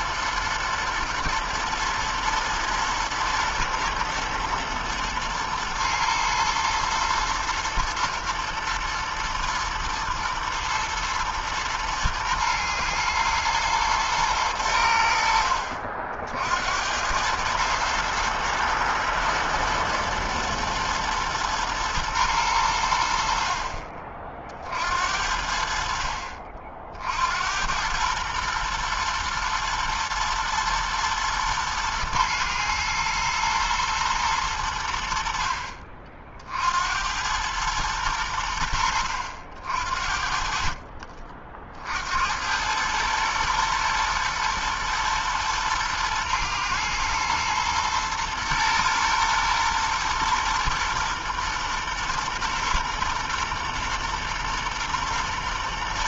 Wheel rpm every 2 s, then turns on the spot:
110, 120, 120, 110, 110, 110, 110, 110, 60, 110, 110, 110, 50, 50, 110, 110, 120, 110, 50, 100, 50, 70, 110, 120, 120, 120, 120, 120.
none